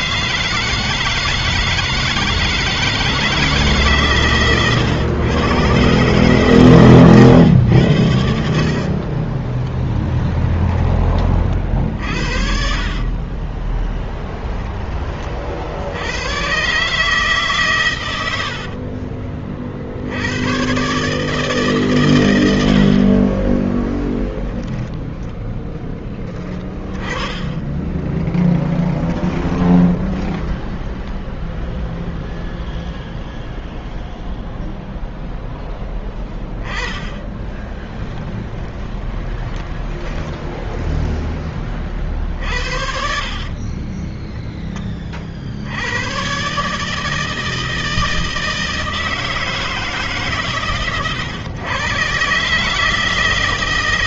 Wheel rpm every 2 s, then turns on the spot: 160, 160, 130, 120, 60, 20, 30, 20, 130, 50, 130, 50, 10, 20, 10, 10, 0, 0, 20, 20, 10, 60, 30, 150, 160, 130, 150.
8-10 12-14 18-20 26-30 36-40 42-44